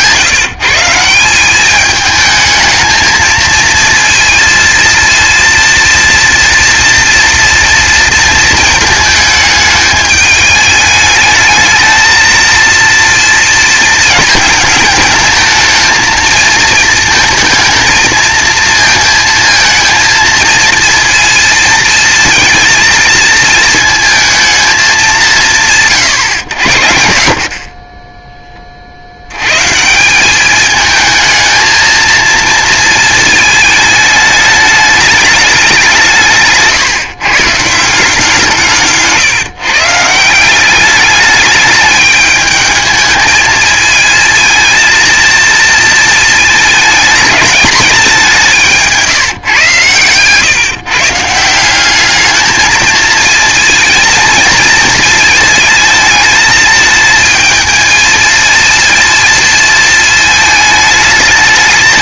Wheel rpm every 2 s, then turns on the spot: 170, 220, 230, 230, 230, 210, 230, 220, 230, 220, 230, 230, 200, 70, 30, 220, 230, 210, 150, 160, 200, 220, 220, 220, 170, 140, 220, 230, 220, 230, 220.
48-50